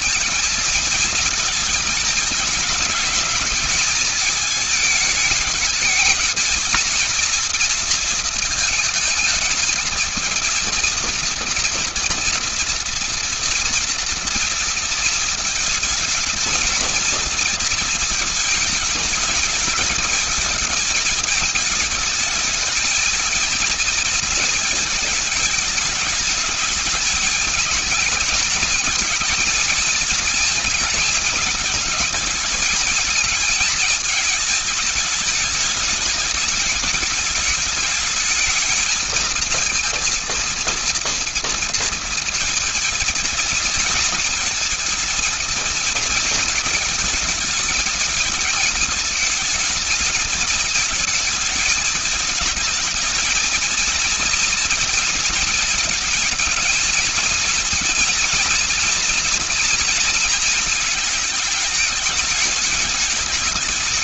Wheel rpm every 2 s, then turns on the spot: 230, 220, 220, 220, 220, 230, 230, 230, 230, 220, 220, 220, 220, 210, 220, 230, 220, 220, 220, 220, 230, 230, 220, 220, 220, 220, 220, 230, 220, 240, 220, 210.
none